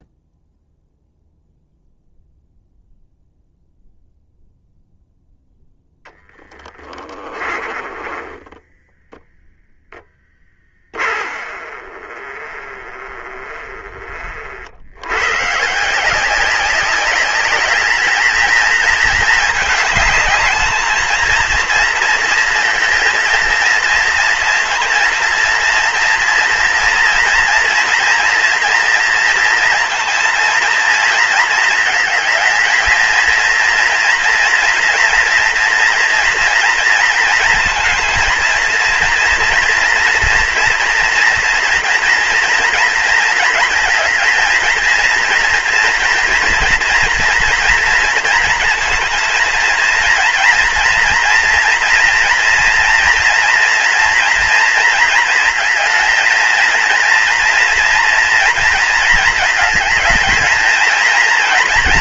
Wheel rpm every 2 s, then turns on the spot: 0, 0, 0, 10, 10, 20, 30, 60, 190, 230, 220, 230, 230, 230, 230, 230, 220, 230, 230, 220, 230, 230, 230, 230, 230, 230, 230, 230, 230, 230, 230.
6-14